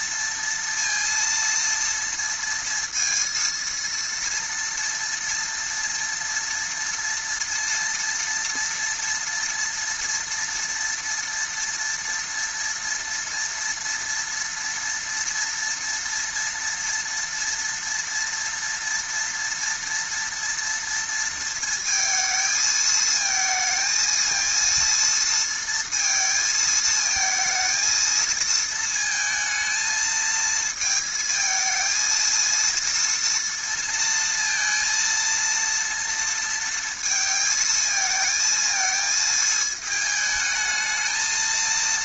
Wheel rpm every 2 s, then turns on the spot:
230, 230, 230, 230, 230, 230, 230, 230, 230, 230, 230, 220, 230, 230, 230, 220, 230, 230, 230, 220, 220.
none